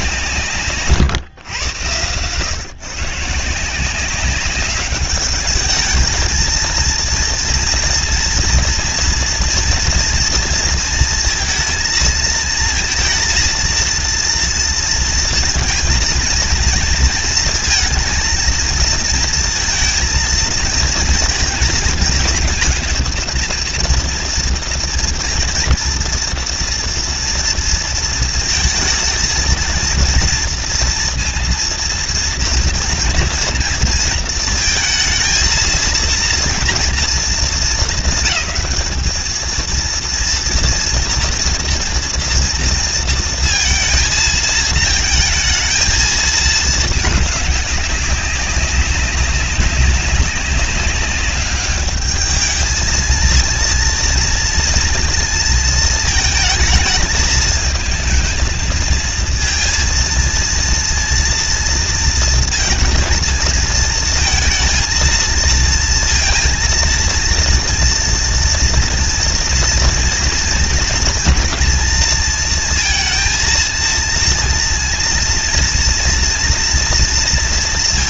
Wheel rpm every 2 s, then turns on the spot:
150, 130, 200, 230, 230, 230, 230, 230, 230, 230, 230, 230, 230, 230, 230, 230, 230, 220, 230, 210, 230, 230, 220, 220, 190, 200, 220, 230, 220, 230, 230, 230, 230, 230, 230, 230, 220, 230, 230.
none